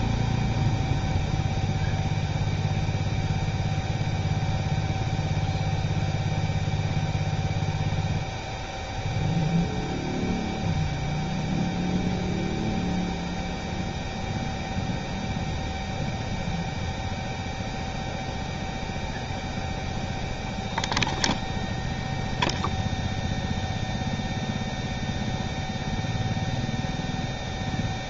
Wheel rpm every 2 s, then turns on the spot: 0, 0, 0, 0, 0, 0, 0, 0, 0, 0, 0, 0, 0, 0.
none